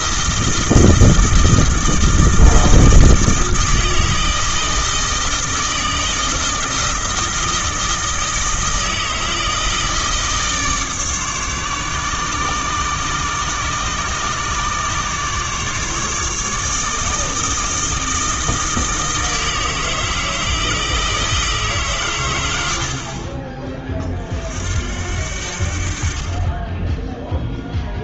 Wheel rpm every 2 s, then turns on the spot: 160, 160, 160, 160, 160, 150, 140, 140, 150, 160, 160, 80, 60, 10.
none